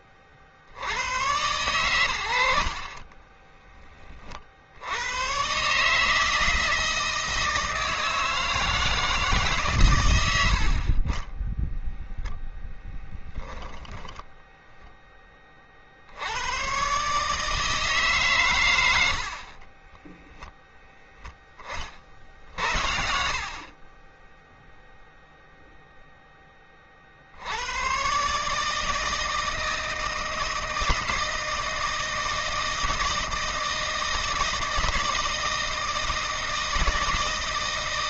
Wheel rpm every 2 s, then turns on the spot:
90, 50, 70, 160, 160, 50, 0, 10, 120, 100, 10, 60, 10, 20, 150, 160, 160, 170, 160.
22-26